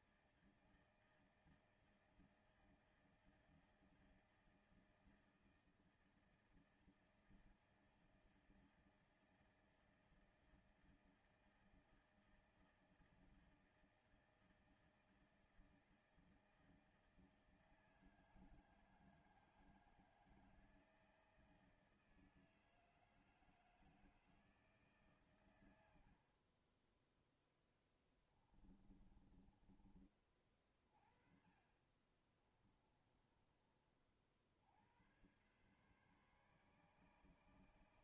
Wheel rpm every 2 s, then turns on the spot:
150, 160, 160, 160, 160, 160, 160, 160, 160, 160, 160, 160, 160, 60, 10, 30, 30, 60, 140.
26-30 32-34